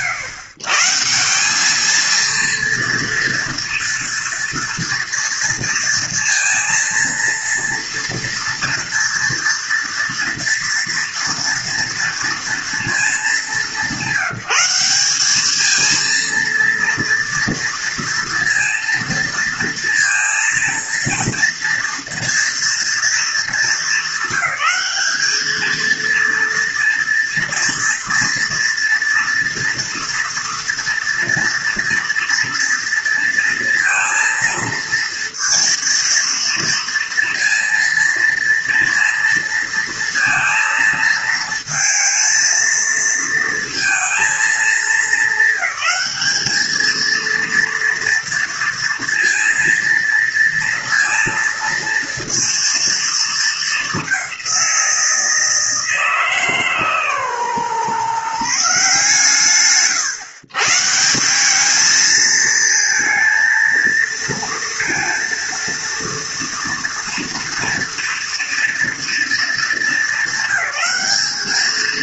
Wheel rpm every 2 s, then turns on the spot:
150, 230, 240, 230, 230, 230, 230, 180, 230, 230, 230, 230, 200, 230, 240, 230, 230, 230, 230, 230, 230, 230, 220, 220, 230, 230, 230, 180, 150, 140, 140, 220, 230, 230, 230, 200.
none